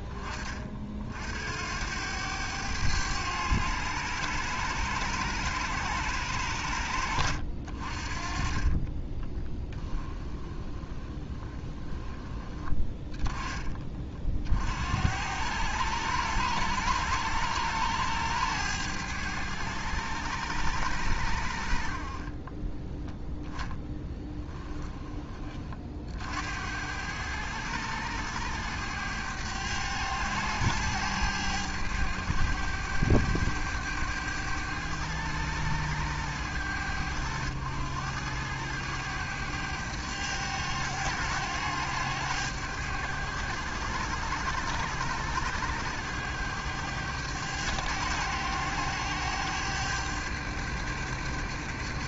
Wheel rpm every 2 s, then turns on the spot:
50, 100, 100, 80, 30, 20, 20, 70, 100, 100, 90, 10, 20, 90, 100, 100, 100, 100, 90, 100, 100, 100, 100, 100, 100, 100.
8-12